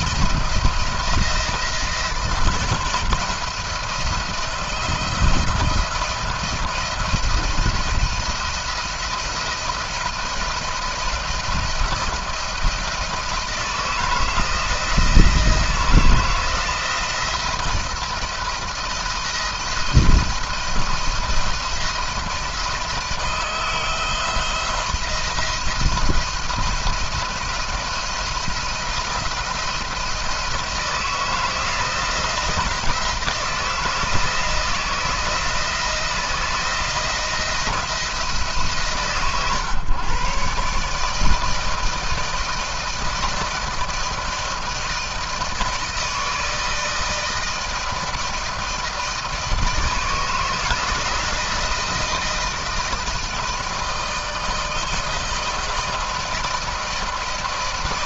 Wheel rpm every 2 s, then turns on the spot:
170, 160, 170, 170, 170, 170, 160, 160, 170, 170, 170, 170, 160, 170, 170, 160, 160, 160, 160, 150, 140, 160, 160, 160, 160, 160, 160, 160, 160.
none